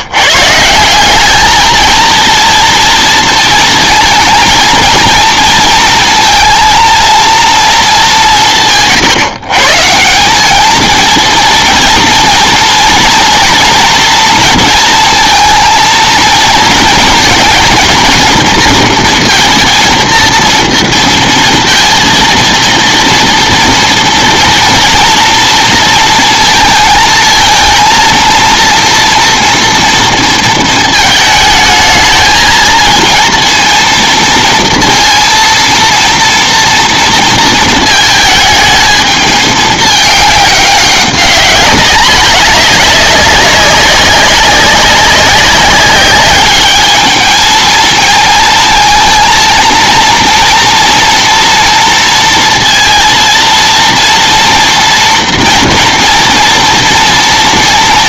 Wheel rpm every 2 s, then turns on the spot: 150, 230, 230, 230, 160, 200, 240, 230, 230, 230, 230, 230, 230, 230, 230, 230, 220, 230, 230, 220, 200, 200, 200, 200, 230, 240, 230, 230, 230.
none